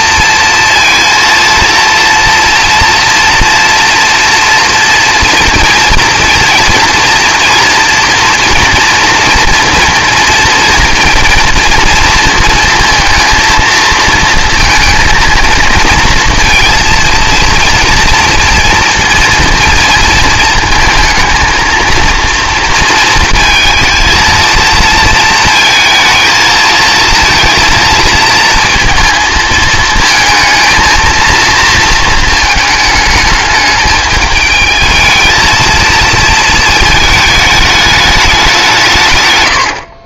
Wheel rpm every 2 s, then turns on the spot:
230, 230, 240, 230, 240, 230, 230, 230, 230, 230, 230, 230, 230, 220, 230, 220, 220, 220, 220, 180.
none